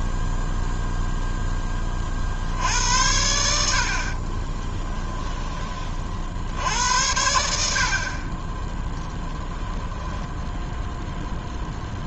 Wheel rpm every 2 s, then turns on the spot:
0, 50, 30, 70, 30, 10.
4-6 10-12